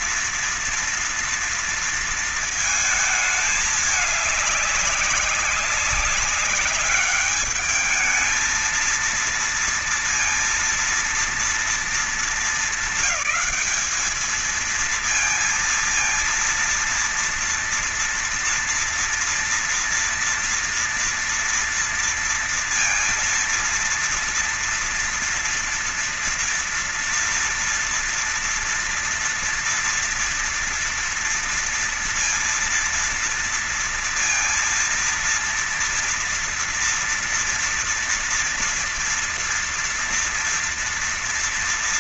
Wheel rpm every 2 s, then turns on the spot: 230, 230, 210, 200, 220, 230, 230, 220, 230, 230, 240, 230, 230, 230, 230, 240, 230, 230, 230, 230, 230.
none